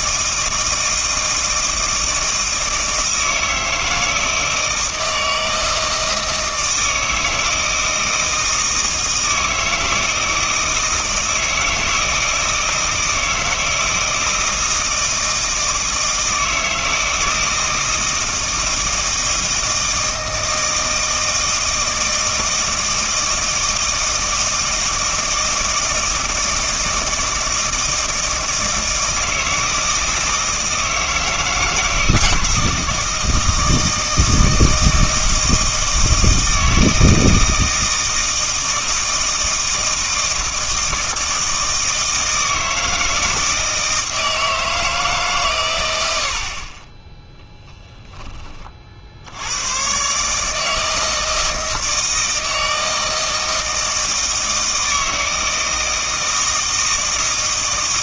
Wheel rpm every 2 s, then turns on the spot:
160, 160, 160, 160, 160, 160, 160, 160, 160, 160, 160, 160, 160, 160, 160, 160, 160, 160, 160, 160, 160, 160, 160, 30, 40, 160, 160, 160, 160.
none